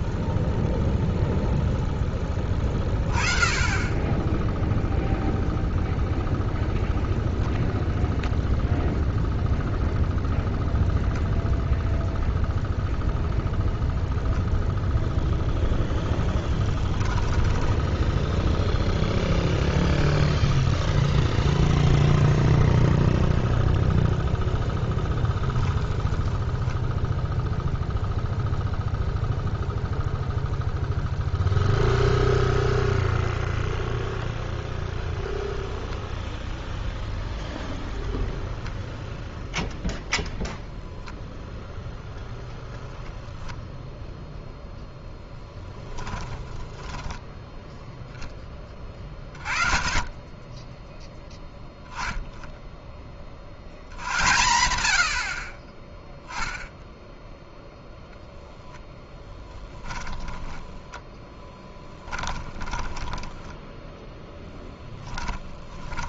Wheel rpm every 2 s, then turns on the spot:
10, 10, 0, 0, 0, 0, 0, 0, 10, 0, 0, 0, 10, 0, 0, 0, 0, 0, 0, 0, 10, 0, 0, 10, 20, 10, 0, 110, 0, 20, 10, 20, 0.
16-18 46-48 62-64